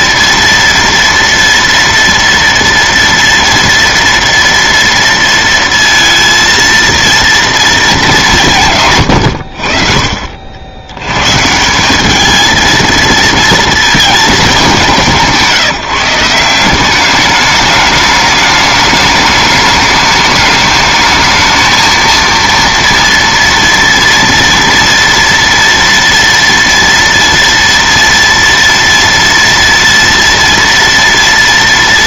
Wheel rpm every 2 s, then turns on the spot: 230, 230, 230, 230, 120, 100, 220, 170, 190, 210, 210, 230, 230, 230, 230, 230.
none